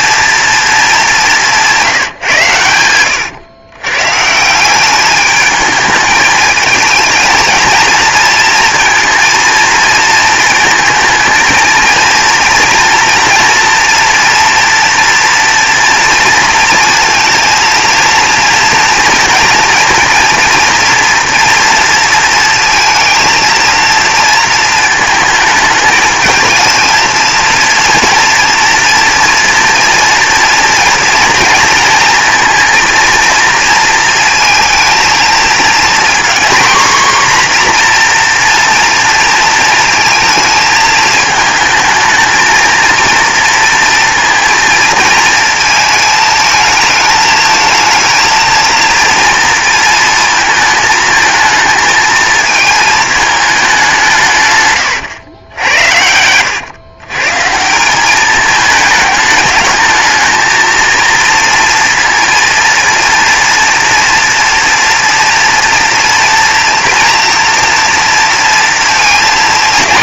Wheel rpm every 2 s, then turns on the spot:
220, 100, 200, 220, 230, 220, 230, 230, 230, 230, 230, 230, 230, 230, 230, 240, 230, 230, 250, 230, 220, 230, 230, 220, 230, 220, 220, 120, 130, 210, 230, 230, 230, 230, 230.
2-4 54-56